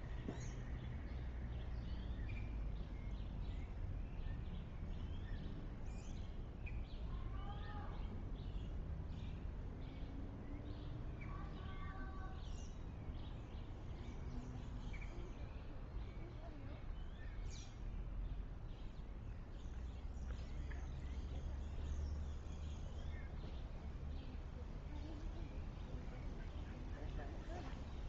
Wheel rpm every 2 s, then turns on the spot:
0, 0, 0, 0, 0, 0, 0, 0, 0, 0, 0, 0, 0, 0.
none